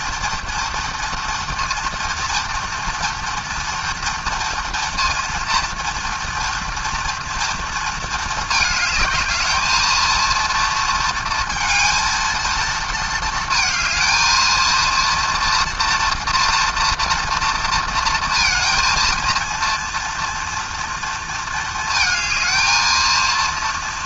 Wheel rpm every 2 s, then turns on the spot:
230, 230, 230, 230, 220, 230, 230, 230, 230, 230, 230, 220.
none